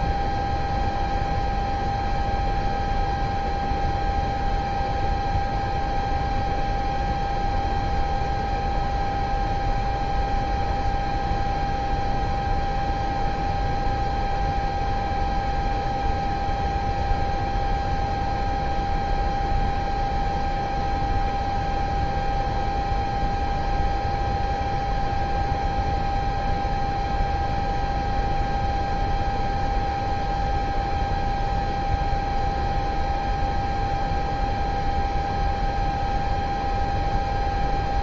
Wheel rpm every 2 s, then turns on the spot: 0, 0, 0, 0, 0, 0, 0, 0, 0, 0, 0, 0, 0, 0, 0, 0, 0, 0, 0.
none